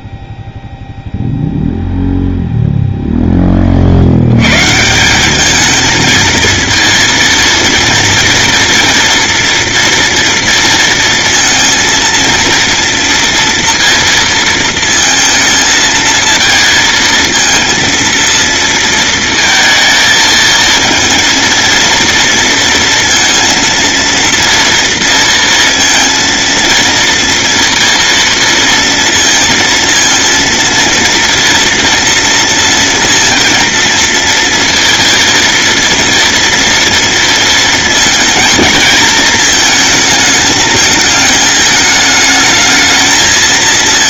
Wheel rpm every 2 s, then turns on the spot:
0, 10, 200, 230, 230, 230, 230, 220, 230, 230, 230, 230, 230, 230, 230, 240, 230, 230, 230, 220, 220, 220.
none